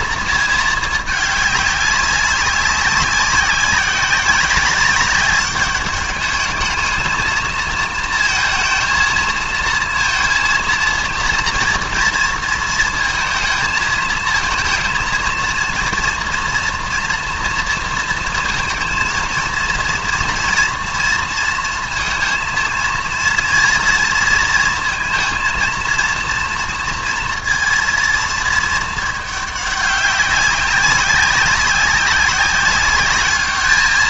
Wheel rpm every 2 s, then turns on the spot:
220, 200, 190, 210, 230, 230, 230, 220, 230, 230, 230, 230, 230, 230, 220, 200, 200.
none